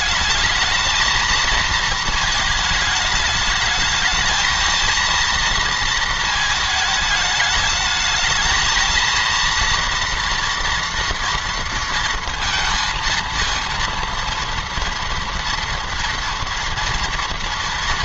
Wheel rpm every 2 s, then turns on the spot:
220, 220, 230, 220, 220, 230, 230, 230, 230.
none